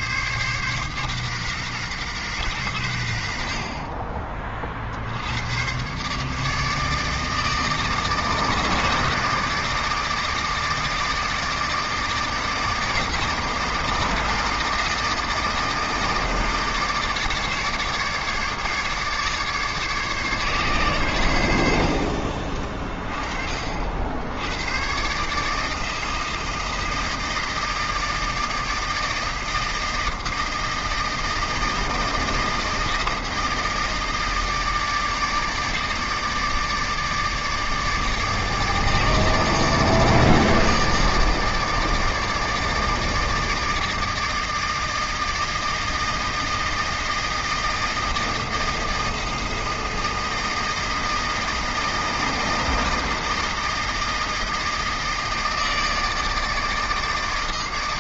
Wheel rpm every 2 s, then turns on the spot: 130, 100, 60, 160, 160, 160, 160, 160, 160, 150, 120, 40, 120, 160, 160, 160, 160, 160, 160, 160, 160, 160, 160, 160, 160, 160, 160, 160, 160.
none